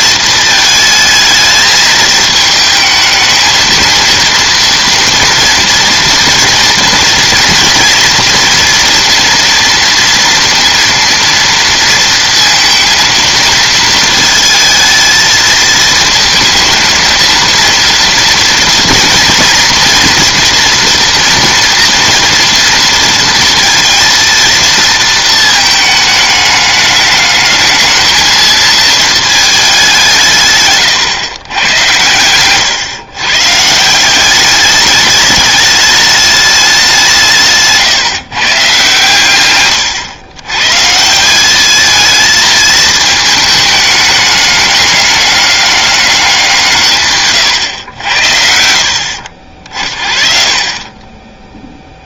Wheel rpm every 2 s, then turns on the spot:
220, 220, 230, 230, 230, 230, 230, 220, 220, 230, 240, 230, 230, 210, 220, 130, 130, 200, 190, 130, 140, 220, 200, 160, 50, 30.
none